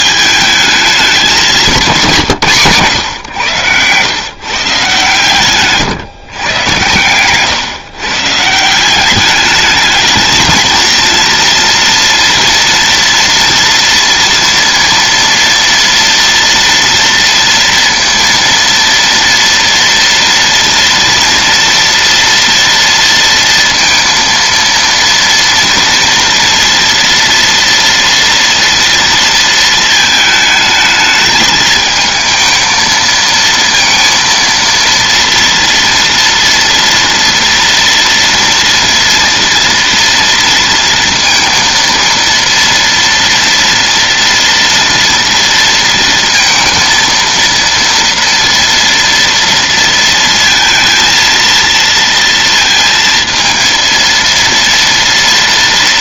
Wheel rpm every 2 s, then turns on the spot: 210, 140, 130, 120, 180, 230, 240, 230, 230, 230, 230, 230, 230, 230, 230, 220, 220, 230, 230, 230, 230, 230, 230, 230, 230, 230, 230, 230.
none